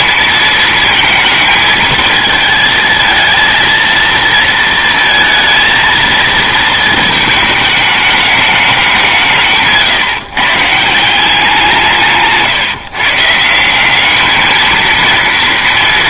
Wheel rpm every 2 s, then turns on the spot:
220, 220, 230, 220, 200, 150, 150, 220.
none